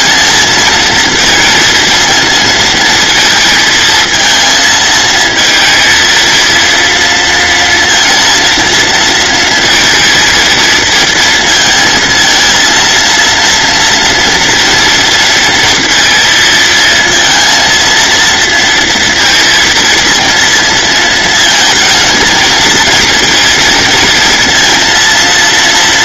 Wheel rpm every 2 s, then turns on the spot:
230, 220, 230, 230, 230, 230, 230, 230, 230, 230, 230, 230, 230.
none